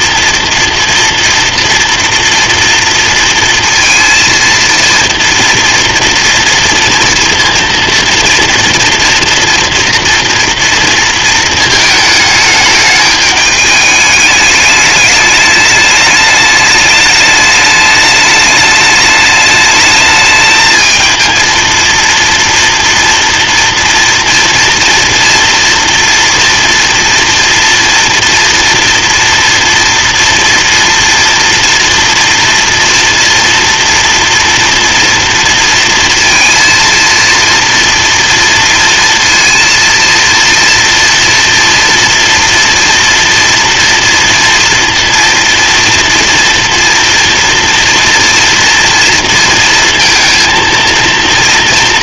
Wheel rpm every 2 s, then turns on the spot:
230, 230, 230, 240, 230, 230, 210, 210, 210, 210, 220, 230, 240, 230, 230, 230, 230, 230, 230, 230, 230, 230, 230, 230, 230, 230.
none